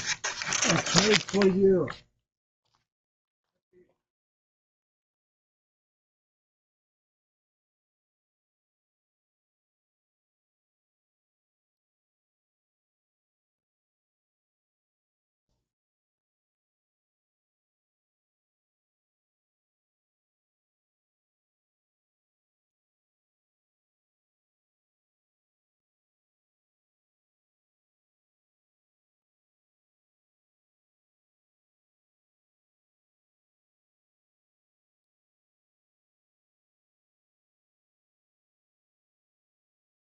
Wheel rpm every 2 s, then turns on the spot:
0, 0, 0, 0, 0, 0, 0, 0, 0, 0, 0, 0, 0, 0, 0, 0, 0, 0, 0, 0.
none